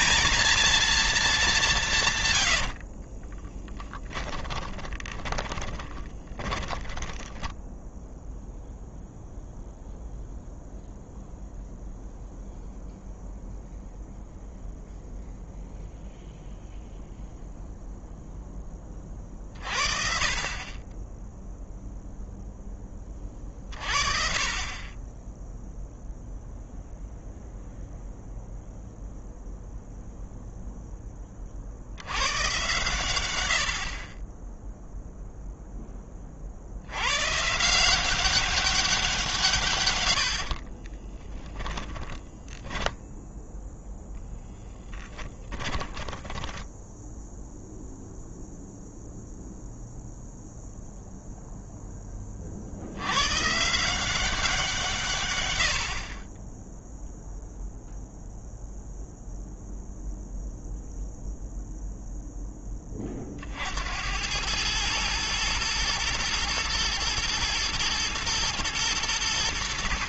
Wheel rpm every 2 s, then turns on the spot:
220, 40, 20, 10, 0, 0, 0, 0, 0, 20, 20, 20, 30, 0, 0, 10, 120, 0, 100, 180, 30, 10, 10, 10, 0, 0, 80, 160, 10, 0, 0, 20, 110, 120, 110.
2-8 40-42